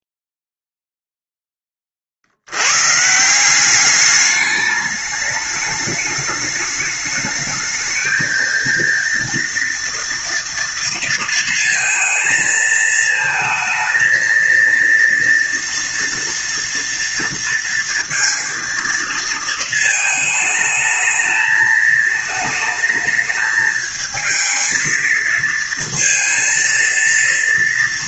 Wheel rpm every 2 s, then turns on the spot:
0, 70, 210, 210, 230, 230, 220, 230, 230, 230, 220, 220, 220, 230.
none